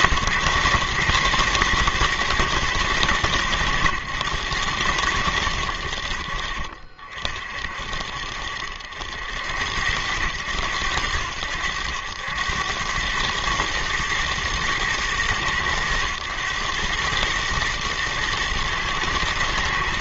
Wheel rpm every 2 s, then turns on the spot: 130, 110, 100, 50, 60, 90, 90, 110, 110, 110.
none